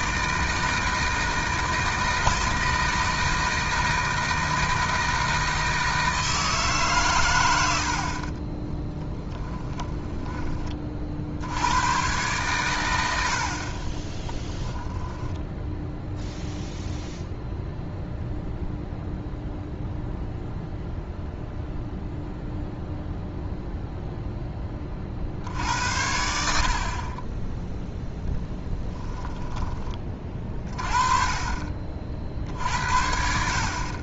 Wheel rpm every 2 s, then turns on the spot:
160, 160, 160, 140, 20, 40, 100, 10, 0, 0, 0, 0, 20, 50, 10, 30, 60.
8-10 14-16 28-30